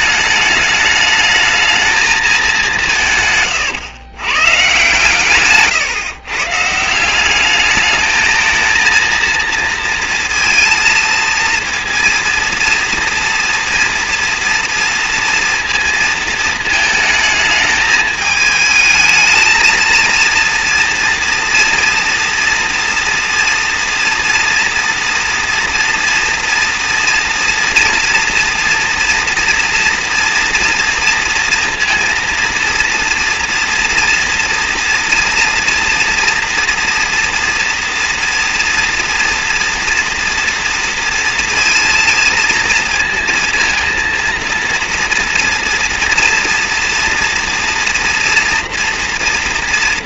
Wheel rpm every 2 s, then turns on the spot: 210, 200, 140, 150, 220, 230, 230, 230, 220, 220, 230, 230, 230, 230, 230, 230, 230, 230, 240, 230, 230, 230, 230, 230, 230.
none